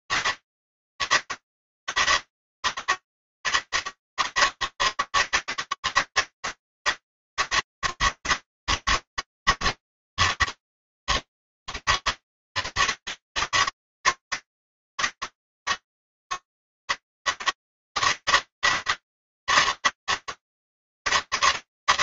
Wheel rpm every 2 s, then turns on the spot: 200, 200, 200, 200, 180, 200, 200, 200, 200, 200, 200.
none